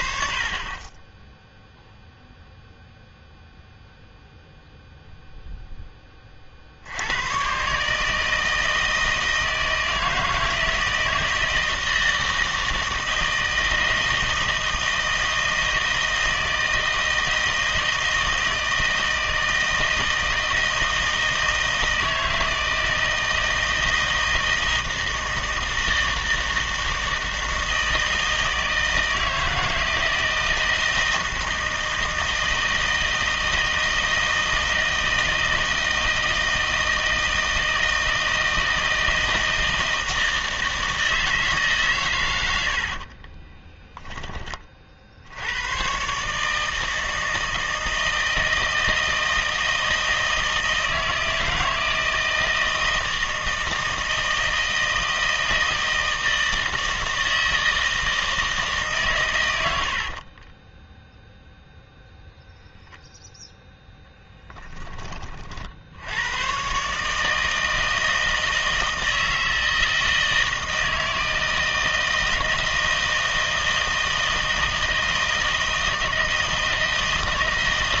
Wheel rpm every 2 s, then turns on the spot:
30, 0, 0, 50, 160, 160, 160, 160, 160, 160, 160, 160, 160, 160, 160, 160, 160, 160, 160, 160, 160, 80, 30, 150, 160, 160, 160, 160, 160, 160, 30, 0, 10, 120, 160, 160, 160, 160, 160.
42-44 60-62